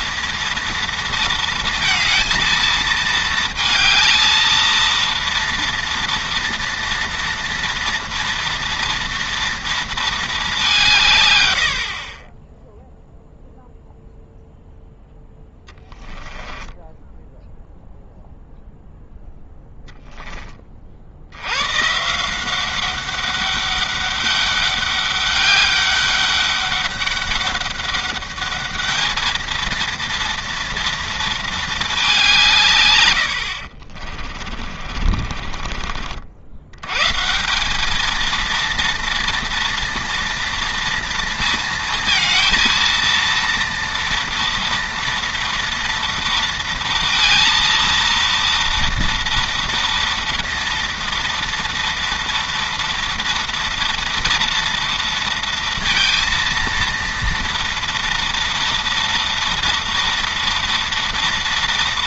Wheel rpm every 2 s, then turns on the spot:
230, 220, 230, 240, 230, 170, 0, 10, 20, 0, 40, 190, 200, 200, 210, 230, 140, 40, 100, 230, 230, 230, 230, 230, 230, 230, 230, 230, 230, 230, 230.
16-18 34-36